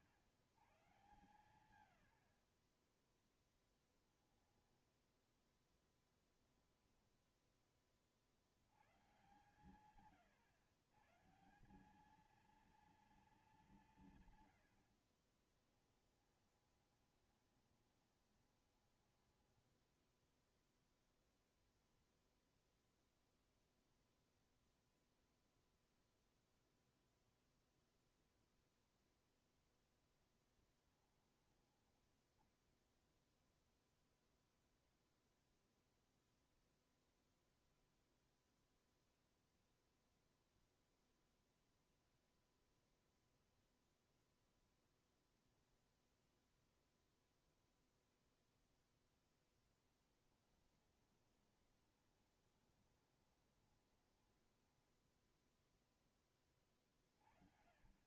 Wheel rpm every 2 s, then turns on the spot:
60, 60, 10, 10, 60, 120, 210, 130, 20, 20, 0, 0, 0, 0, 0, 10, 10, 0, 0, 0, 0, 0, 0, 0, 0, 10, 20, 10, 20.
6-8 14-20 30-32 50-56